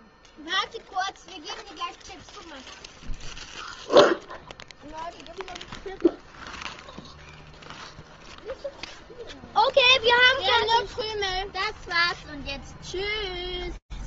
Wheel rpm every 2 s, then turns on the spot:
0, 0, 0, 0, 0, 0, 0.
none